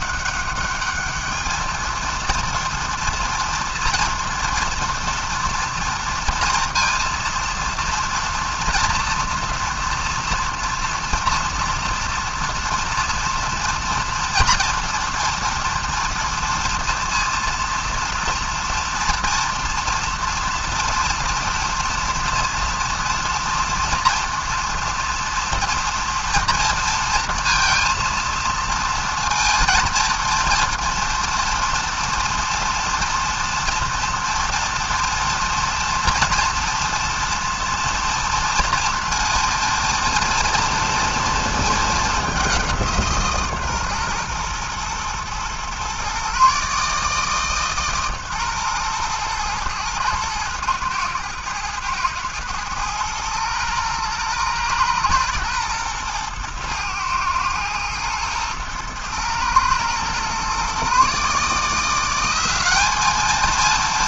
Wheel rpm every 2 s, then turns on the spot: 210, 230, 240, 230, 230, 230, 230, 240, 230, 230, 230, 230, 230, 230, 230, 230, 230, 230, 230, 230, 230, 180, 120, 140, 120, 110, 110, 110, 110, 110, 130, 200.
none